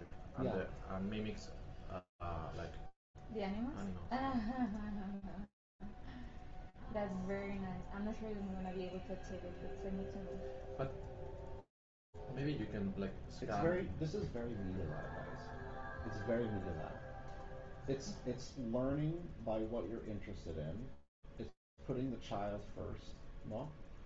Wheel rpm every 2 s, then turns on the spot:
0, 0, 0, 0, 0, 0, 0, 0, 0, 0, 0, 0.
none